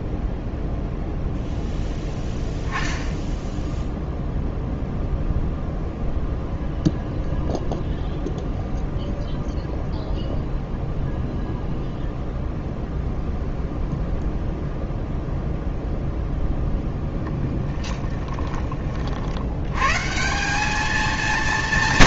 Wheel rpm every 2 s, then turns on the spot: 0, 10, 0, 0, 0, 0, 0, 0, 0, 20, 200.
none